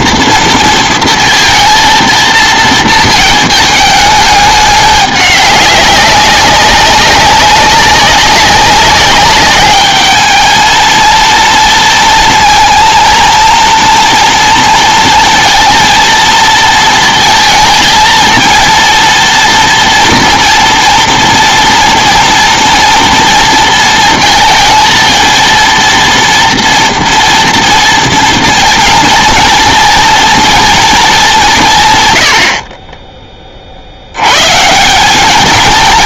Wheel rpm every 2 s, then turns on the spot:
230, 220, 210, 200, 200, 220, 230, 230, 230, 230, 230, 230, 220, 230, 230, 230, 40, 150.
32-34